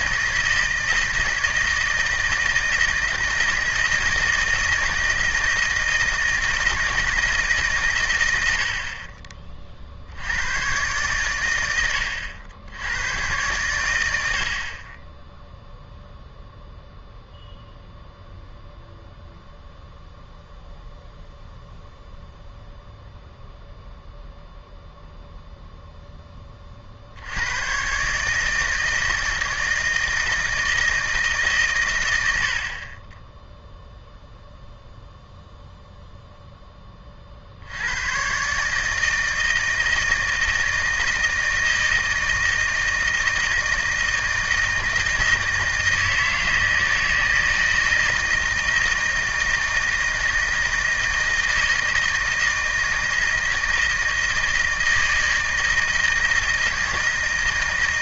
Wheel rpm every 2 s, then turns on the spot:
160, 160, 160, 160, 70, 110, 90, 60, 0, 0, 0, 0, 0, 30, 160, 160, 60, 0, 10, 140, 160, 160, 160, 160, 160, 160, 160, 160, 160.
none